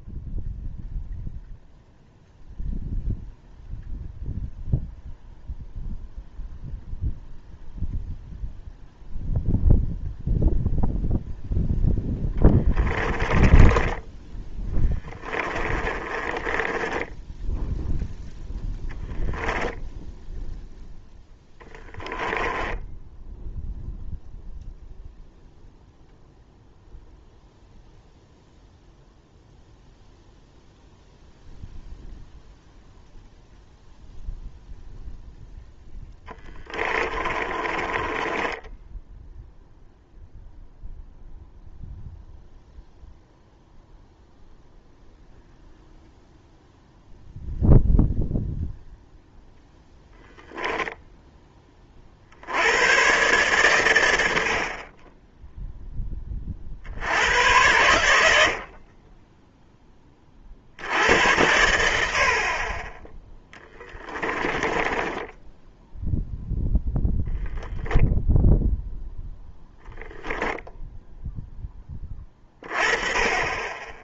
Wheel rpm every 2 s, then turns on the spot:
0, 0, 0, 0, 0, 0, 10, 20, 30, 0, 0, 10, 0, 0, 0, 0, 0, 0, 30, 10, 0, 0, 0, 0, 0, 0, 80, 40, 60, 50, 70, 20, 10, 10, 10, 0, 30.
12-18 22-24 36-40 64-66